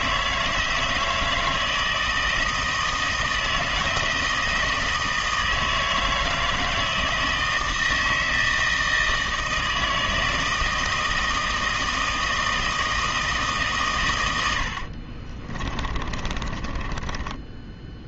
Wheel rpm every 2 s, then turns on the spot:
160, 160, 160, 160, 160, 160, 160, 80, 20.
14-18